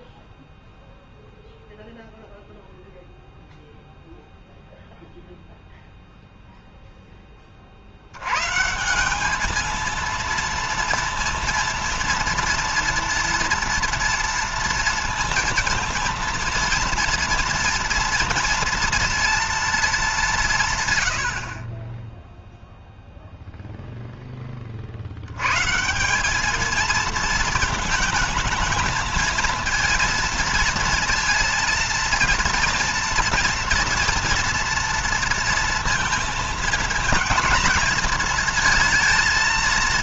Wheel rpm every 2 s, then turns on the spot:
0, 0, 0, 10, 170, 230, 230, 230, 230, 230, 130, 0, 50, 220, 220, 230, 230, 230, 220, 220.
none